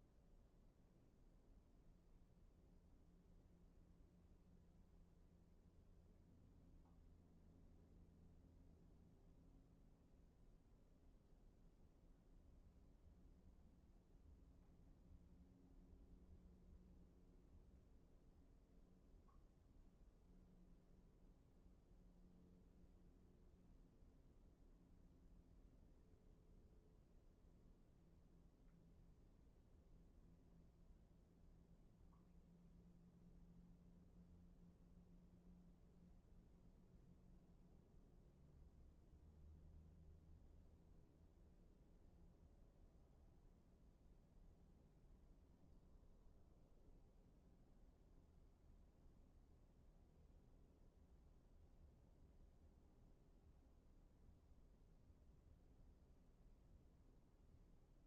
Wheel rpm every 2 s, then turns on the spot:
0, 0, 0, 0, 0, 0, 0, 0, 0, 0, 0, 0, 0, 0, 0, 0, 0, 0, 0, 0, 0, 0, 0, 0, 0, 0, 0, 0, 0.
none